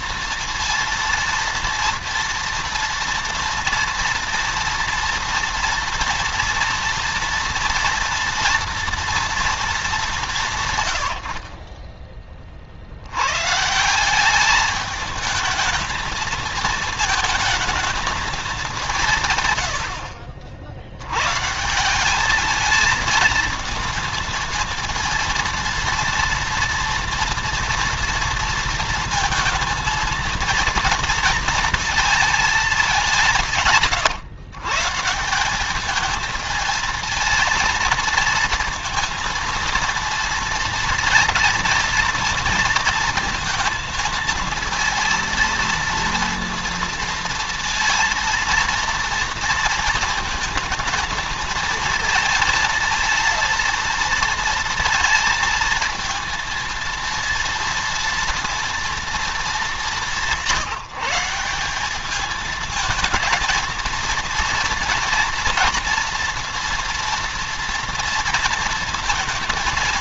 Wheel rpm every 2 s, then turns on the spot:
230, 230, 230, 230, 230, 120, 50, 210, 220, 200, 80, 220, 230, 230, 230, 230, 200, 130, 220, 230, 230, 230, 230, 230, 230, 220, 230, 230, 230, 240, 180, 230, 230, 230, 230.
none